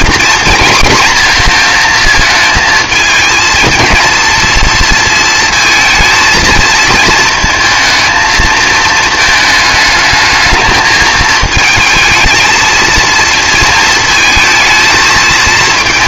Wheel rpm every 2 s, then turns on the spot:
230, 220, 230, 230, 220, 220, 230, 220.
none